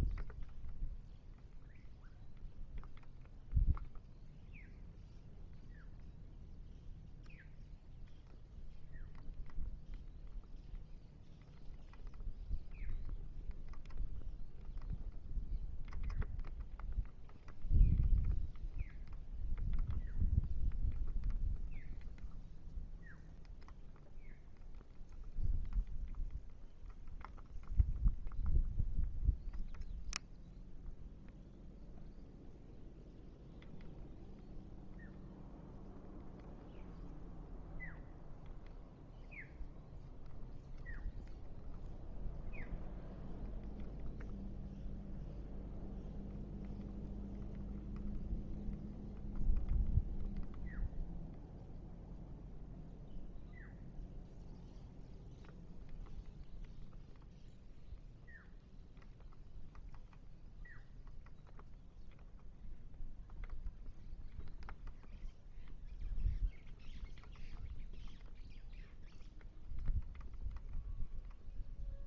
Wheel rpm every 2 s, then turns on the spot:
0, 0, 0, 0, 0, 0, 0, 0, 0, 0, 0, 0, 0, 0, 0, 0, 0, 0, 0, 0, 0, 0, 0, 0, 0, 0, 0, 0, 0, 0, 0, 0, 0, 0, 0, 0.
none